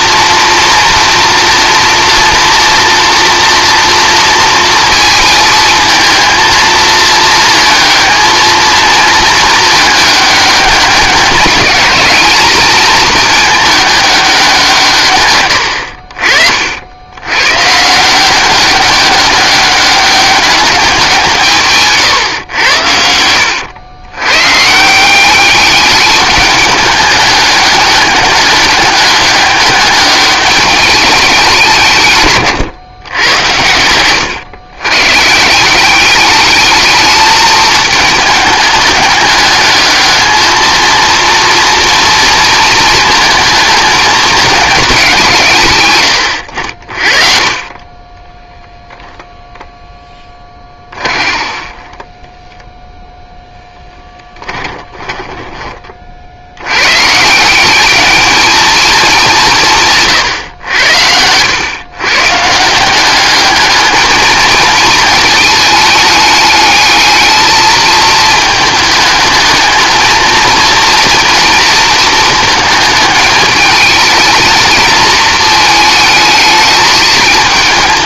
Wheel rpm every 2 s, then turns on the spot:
230, 230, 230, 230, 220, 200, 220, 180, 60, 190, 190, 90, 150, 210, 200, 200, 120, 120, 210, 210, 220, 230, 210, 70, 0, 20, 0, 20, 100, 220, 100, 160, 220, 210, 220, 230, 220, 230, 210.
32-34 50-52 54-56